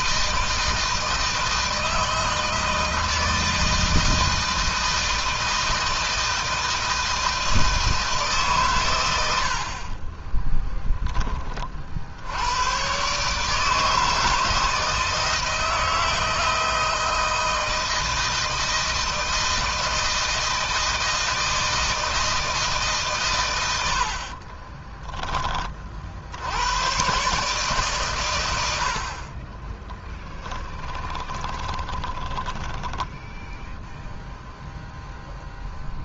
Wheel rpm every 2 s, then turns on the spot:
160, 160, 160, 160, 110, 20, 130, 160, 160, 160, 160, 140, 10, 120, 70, 20, 10, 0.
30-34